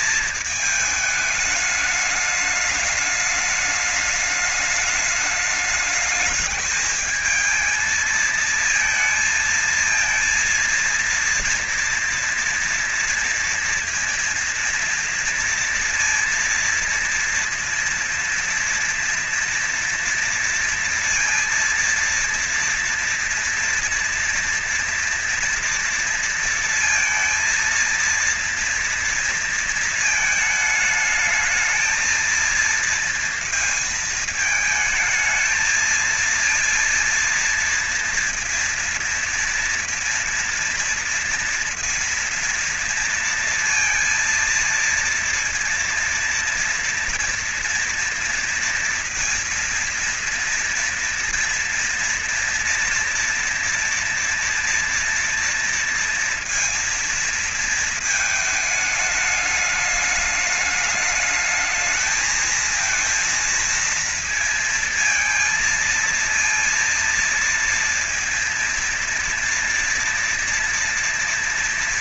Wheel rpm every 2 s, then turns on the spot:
220, 210, 210, 210, 230, 230, 230, 230, 230, 230, 230, 230, 240, 230, 230, 220, 230, 220, 230, 230, 230, 230, 230, 230, 230, 240, 230, 230, 230, 210, 210, 230, 230, 230, 230, 230.
none